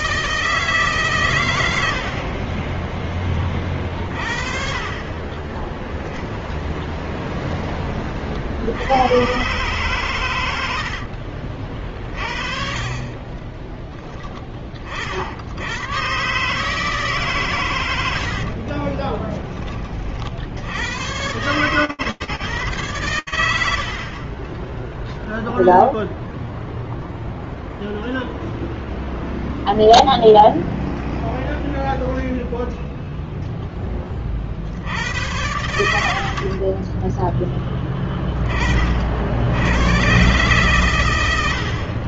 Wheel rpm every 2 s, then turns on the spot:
160, 40, 50, 0, 60, 110, 30, 10, 120, 80, 60, 130, 20, 0, 0, 0, 0, 90, 10, 50, 110.
18-20